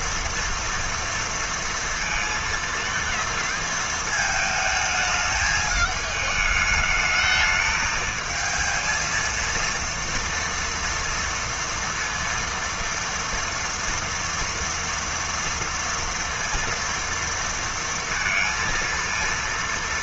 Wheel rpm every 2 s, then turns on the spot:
230, 230, 220, 210, 230, 230, 240, 230, 230, 230.
none